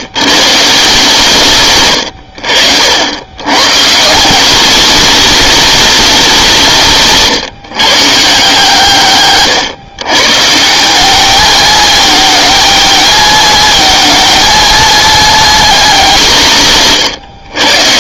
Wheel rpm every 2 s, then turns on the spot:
140, 70, 190, 180, 150, 160, 220, 220, 160.
none